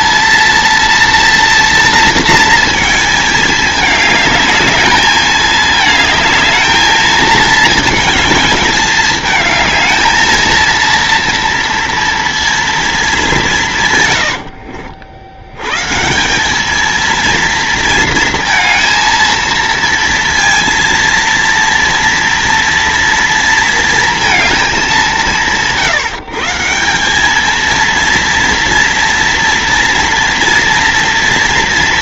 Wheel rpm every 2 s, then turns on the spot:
230, 230, 210, 220, 220, 230, 230, 80, 200, 220, 230, 230, 210, 170, 230, 240.
14-16